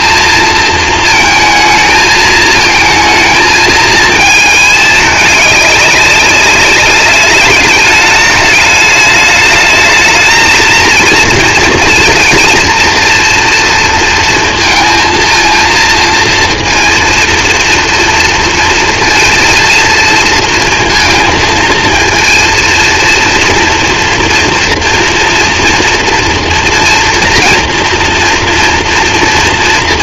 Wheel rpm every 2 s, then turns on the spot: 220, 220, 210, 200, 210, 230, 230, 230, 230, 230, 230, 230, 240, 230, 230.
none